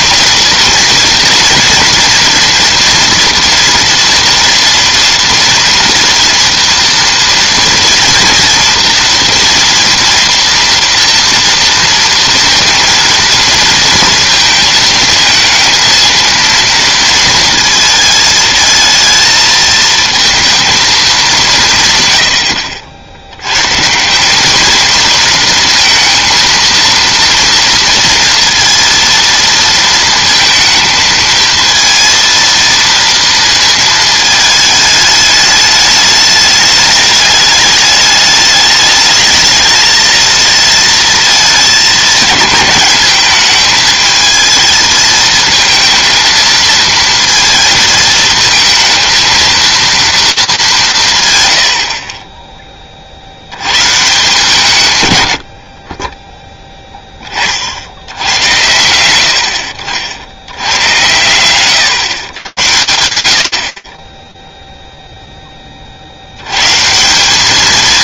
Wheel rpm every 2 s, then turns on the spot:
230, 230, 240, 230, 230, 230, 230, 220, 230, 220, 230, 70, 220, 230, 230, 220, 230, 220, 210, 210, 230, 210, 220, 230, 220, 200, 20, 140, 10, 100, 90, 110, 0, 120.
none